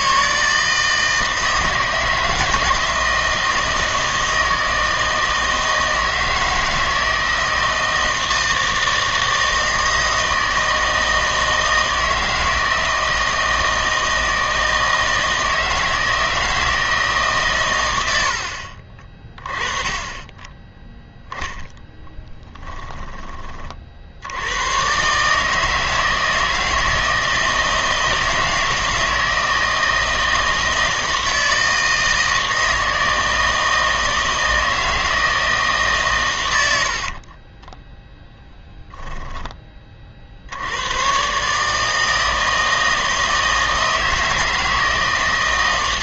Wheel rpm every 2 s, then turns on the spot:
160, 160, 160, 160, 160, 160, 160, 160, 160, 60, 10, 20, 100, 160, 160, 160, 160, 160, 90, 10, 90, 160, 160.
22-24 38-40